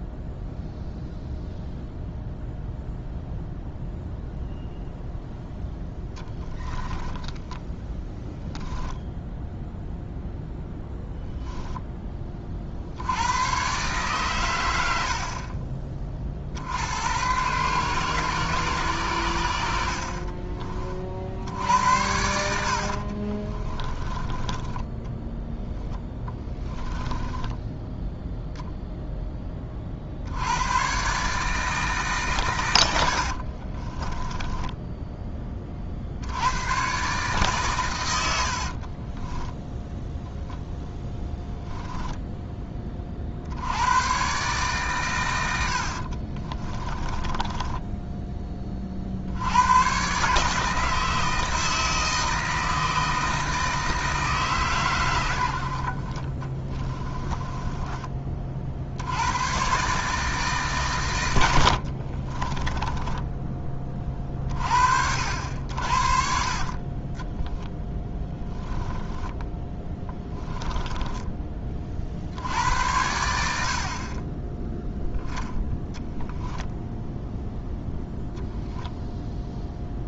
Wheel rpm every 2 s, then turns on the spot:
0, 0, 0, 10, 10, 0, 60, 80, 80, 130, 40, 80, 10, 10, 0, 120, 90, 10, 130, 40, 0, 20, 120, 20, 40, 160, 160, 130, 20, 70, 140, 20, 60, 40, 10, 10, 90, 10, 10, 0.
6-8 24-28 32-36 38-40 46-48 56-58 62-64 68-72